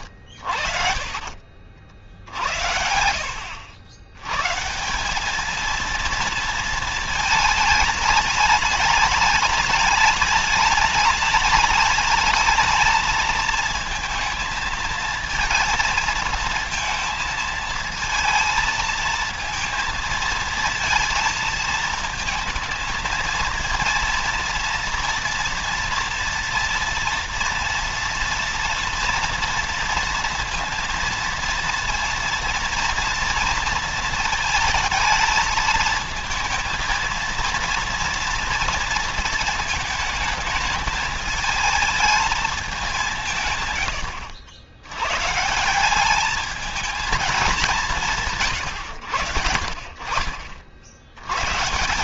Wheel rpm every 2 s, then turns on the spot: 40, 70, 150, 230, 210, 210, 220, 230, 220, 230, 230, 230, 230, 230, 230, 230, 230, 220, 230, 230, 220, 200, 100, 220, 100, 70.
none